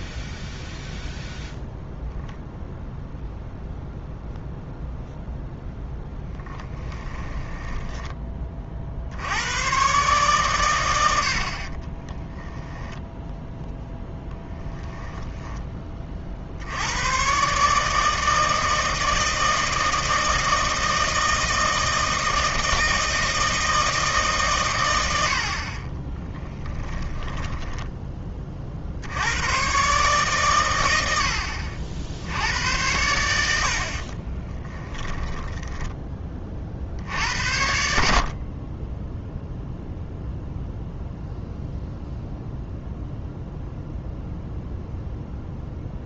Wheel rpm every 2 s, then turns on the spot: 0, 0, 0, 10, 40, 110, 10, 0, 80, 160, 160, 160, 120, 10, 50, 110, 90, 10, 50, 30, 0, 0, 0.
6-8 26-28 34-36